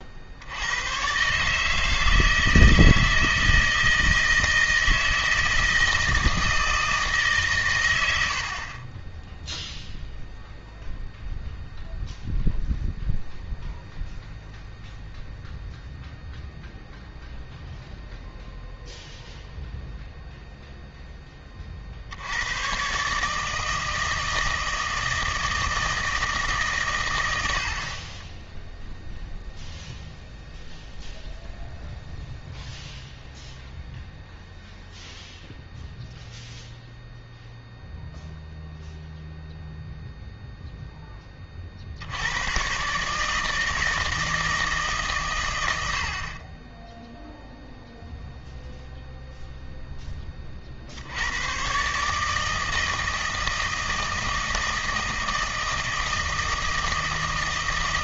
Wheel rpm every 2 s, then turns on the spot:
90, 160, 160, 160, 30, 0, 0, 0, 0, 0, 0, 110, 160, 140, 0, 0, 0, 0, 0, 0, 0, 120, 160, 20, 0, 40, 160, 160, 160.
none